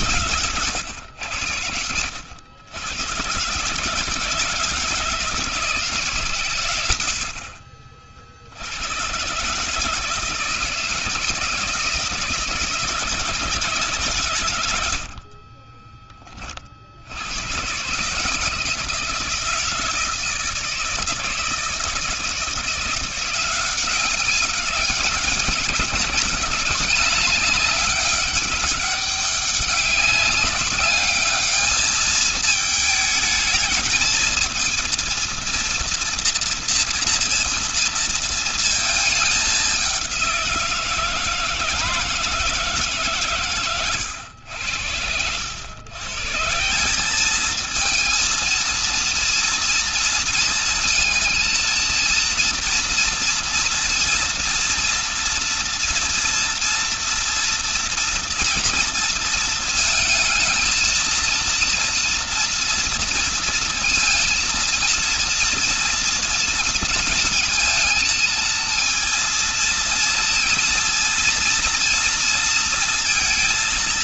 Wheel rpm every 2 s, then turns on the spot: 90, 110, 170, 80, 110, 160, 170, 60, 80, 160, 160, 170, 190, 200, 200, 200, 220, 230, 230, 220, 160, 140, 90, 200, 230, 220, 230, 230, 230, 230, 230, 240, 230, 230, 230, 230, 230.
14-16